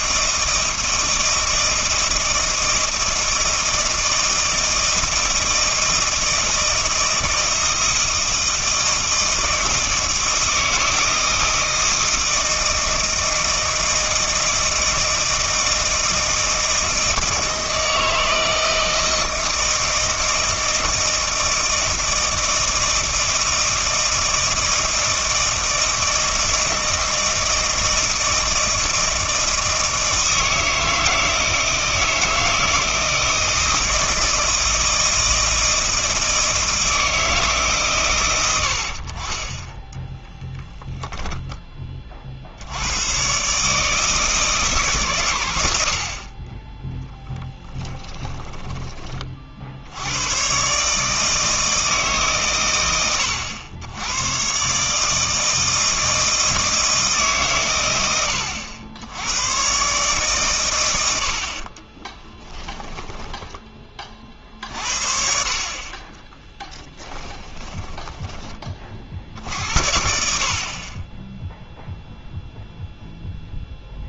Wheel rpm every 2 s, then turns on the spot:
160, 160, 160, 160, 160, 160, 160, 160, 160, 160, 160, 160, 160, 160, 160, 160, 160, 160, 160, 80, 0, 80, 150, 20, 10, 130, 110, 130, 160, 90, 110, 20, 50, 10, 20, 40, 0.
48-50 62-64 66-68